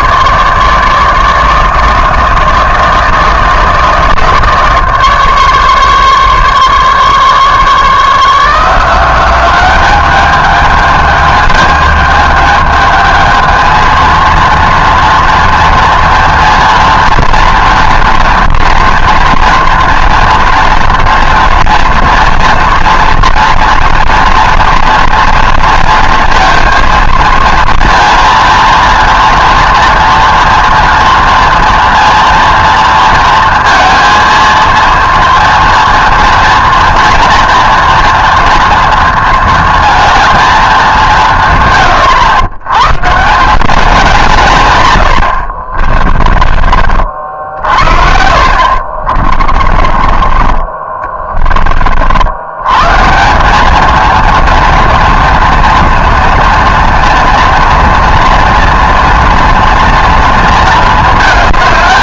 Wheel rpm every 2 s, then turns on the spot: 150, 160, 160, 140, 170, 210, 220, 230, 230, 230, 230, 240, 230, 230, 230, 230, 230, 230, 230, 230, 210, 110, 120, 40, 50, 30, 110, 230, 230, 240, 230.
48-50